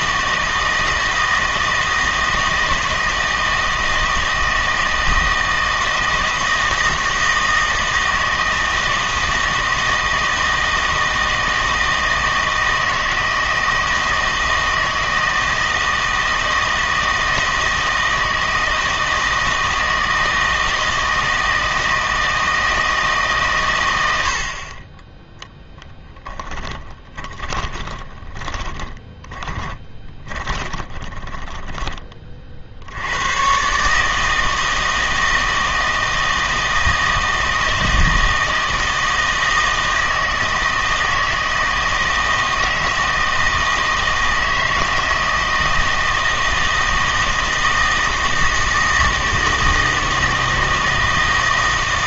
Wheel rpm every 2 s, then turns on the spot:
160, 160, 160, 160, 160, 160, 160, 160, 160, 160, 160, 160, 30, 20, 20, 20, 60, 160, 160, 160, 160, 160, 160, 160, 160, 160.
26-32